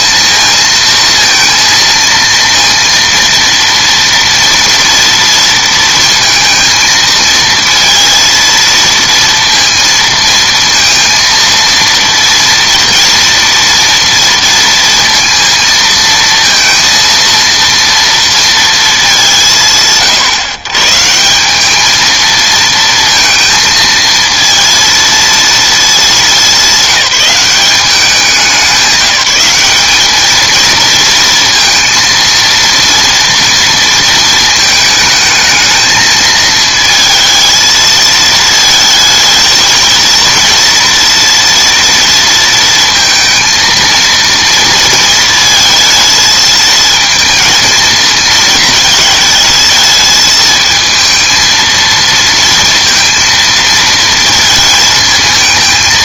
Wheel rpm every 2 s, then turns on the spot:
220, 230, 230, 230, 230, 230, 230, 230, 230, 220, 130, 230, 230, 210, 190, 230, 230, 220, 220, 220, 230, 230, 230, 220, 220, 220, 230, 220.
none